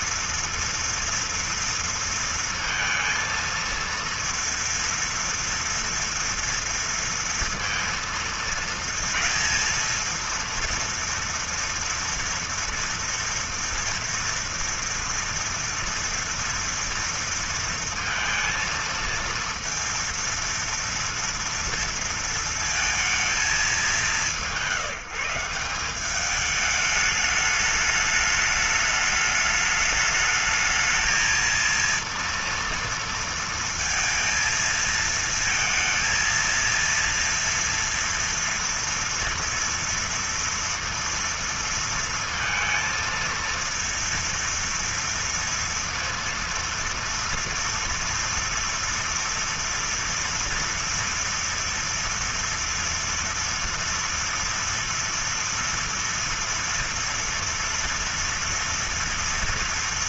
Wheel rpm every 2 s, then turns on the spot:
230, 230, 230, 230, 230, 230, 230, 240, 230, 230, 230, 230, 180, 210, 210, 220, 230, 230, 230, 230, 230, 230, 230, 230, 230, 240, 230, 230, 230, 230.
none